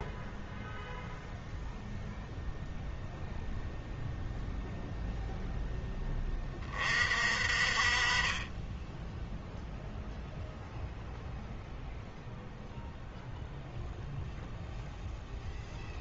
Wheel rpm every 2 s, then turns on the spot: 0, 0, 0, 30, 10, 0, 0, 0.
none